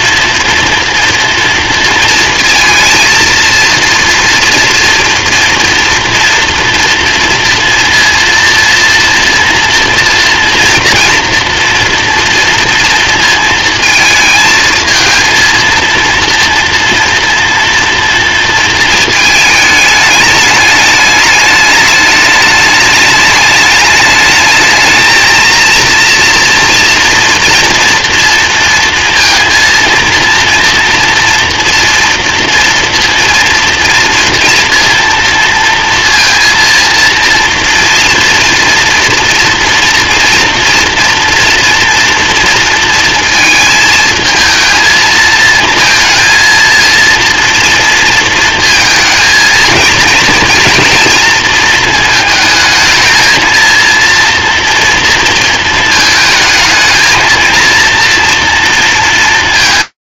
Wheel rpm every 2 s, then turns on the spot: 230, 230, 230, 230, 230, 240, 240, 230, 220, 230, 220, 210, 210, 230, 230, 230, 230, 230, 230, 230, 240, 230, 220, 230, 230, 230, 230, 230, 230, 230.
none